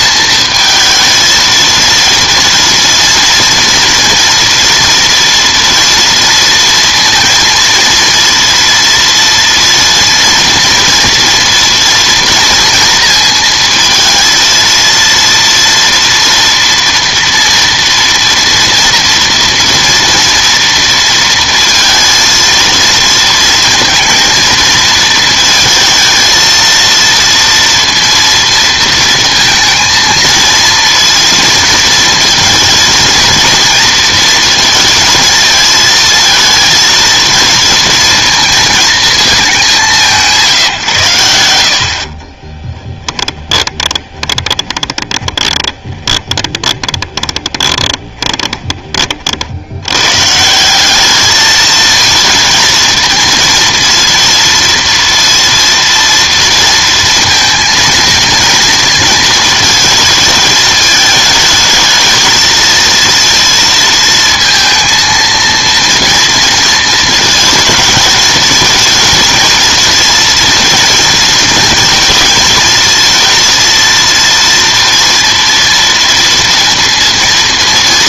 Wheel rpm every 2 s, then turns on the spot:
220, 230, 230, 230, 230, 230, 230, 230, 230, 230, 230, 230, 230, 230, 230, 230, 230, 230, 230, 230, 160, 20, 20, 20, 20, 180, 230, 230, 230, 230, 220, 230, 230, 220, 220, 230, 220, 230, 230.
42-50